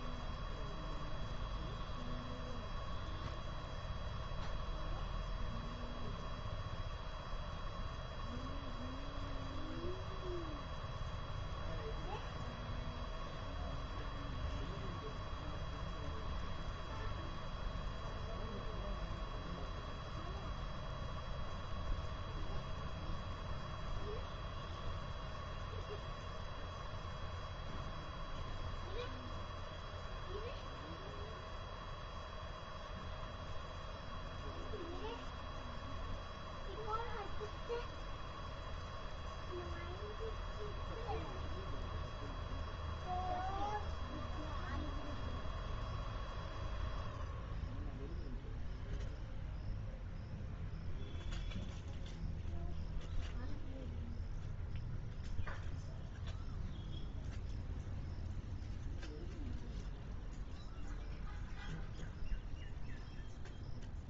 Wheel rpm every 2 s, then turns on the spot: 0, 0, 0, 0, 0, 0, 0, 0, 0, 0, 0, 0, 0, 0, 0, 0, 0, 0, 0, 0, 0, 0, 0, 0, 0, 0, 0, 0, 0, 0, 0, 0.
none